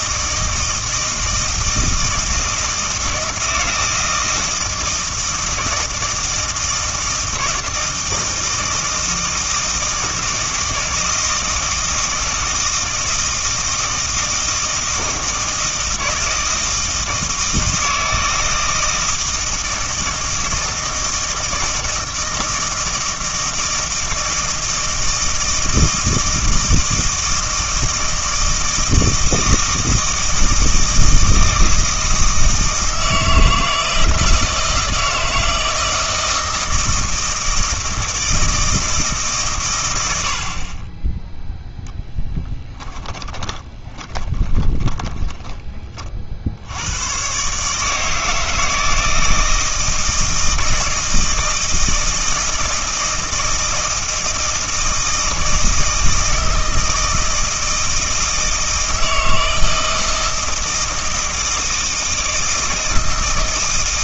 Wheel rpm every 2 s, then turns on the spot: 160, 160, 160, 160, 160, 160, 160, 160, 160, 160, 160, 160, 160, 160, 160, 160, 160, 160, 160, 160, 30, 10, 20, 80, 160, 160, 160, 160, 160, 160, 160, 160.
42-46